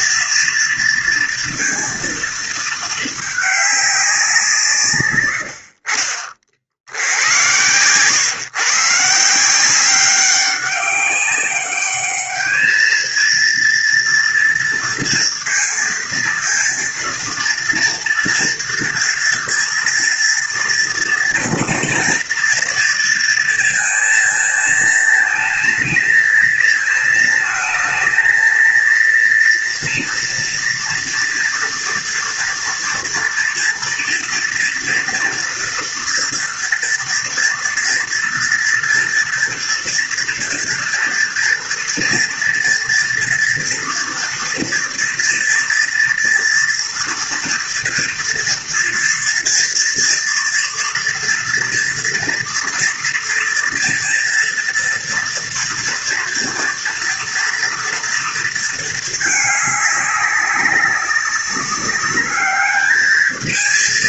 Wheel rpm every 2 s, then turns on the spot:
230, 220, 110, 80, 150, 200, 220, 230, 230, 230, 230, 230, 220, 230, 230, 230, 230, 240, 240, 240, 240, 230, 230, 230, 240, 230, 230, 230, 240, 220, 190, 220.
4-6